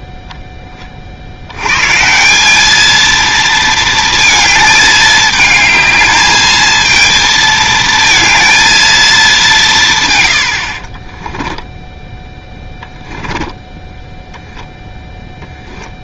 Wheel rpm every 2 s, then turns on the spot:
20, 210, 220, 220, 230, 60, 10, 0.
10-14